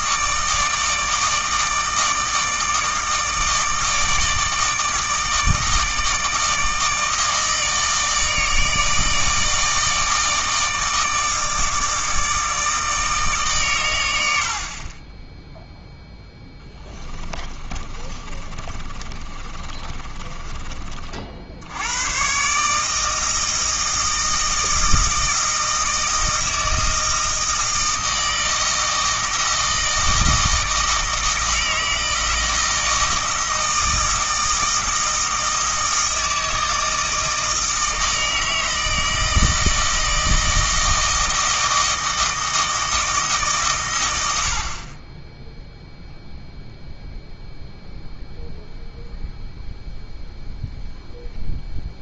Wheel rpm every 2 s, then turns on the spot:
160, 160, 160, 160, 160, 160, 160, 40, 10, 30, 30, 150, 160, 160, 160, 160, 160, 160, 160, 160, 160, 160, 40, 0, 0, 0.
16-20